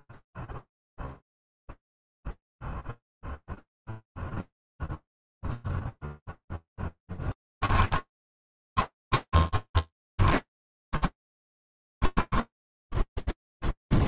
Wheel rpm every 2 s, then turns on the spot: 0, 0, 0, 10, 40, 50, 20.
6-14